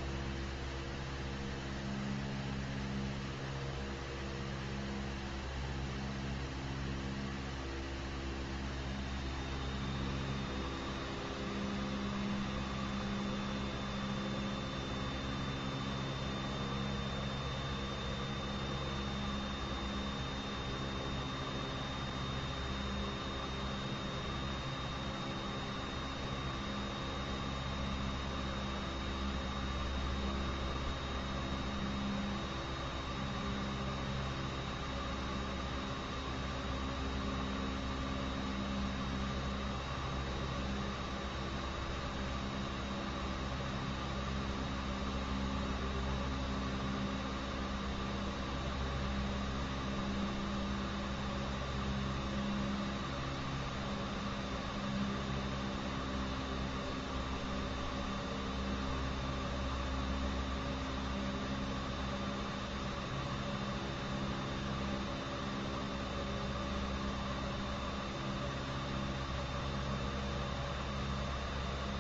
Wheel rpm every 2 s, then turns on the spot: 0, 0, 0, 0, 0, 0, 0, 0, 0, 0, 0, 0, 0, 0, 0, 0, 0, 0, 0, 0, 0, 0, 0, 0, 0, 0, 0, 0, 0, 0, 0, 0, 0, 0, 0, 0.
none